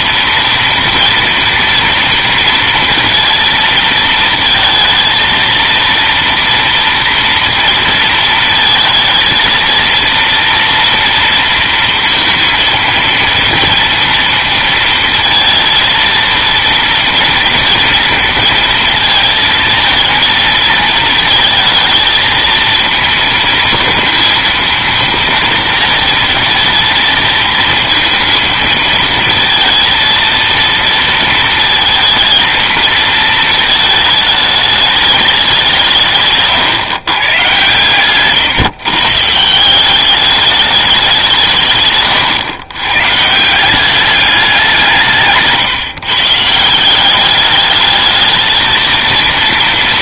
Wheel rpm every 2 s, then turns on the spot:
230, 230, 230, 230, 230, 230, 230, 230, 230, 230, 220, 220, 230, 230, 230, 230, 220, 210, 130, 140, 210, 130, 180, 170, 220.
none